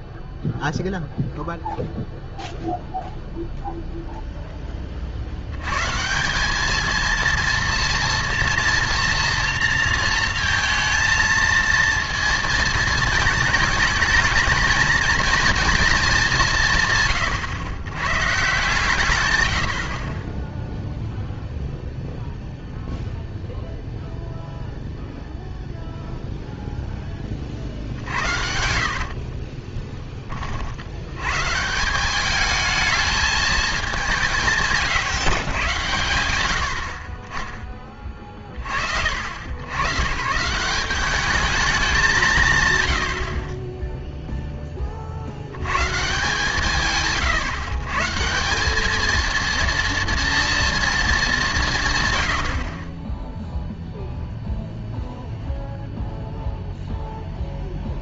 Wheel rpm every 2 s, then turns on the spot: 0, 0, 10, 210, 240, 220, 230, 230, 150, 140, 0, 0, 0, 0, 60, 60, 220, 140, 70, 40, 170, 130, 10, 160, 190, 230, 50, 0, 0.
28-30 34-36